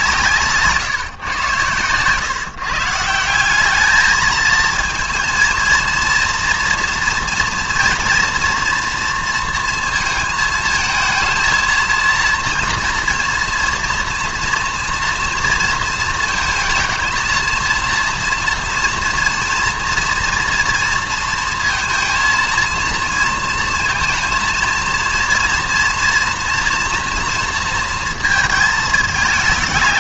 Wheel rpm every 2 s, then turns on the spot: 150, 140, 230, 240, 230, 220, 230, 230, 220, 230, 230, 230, 230, 230, 220.
none